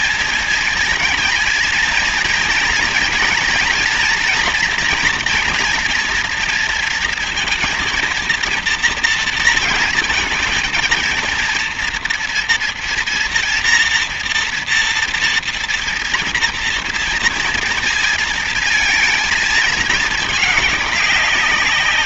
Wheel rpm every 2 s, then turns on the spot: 220, 230, 240, 230, 230, 220, 230, 240, 230, 230, 210.
none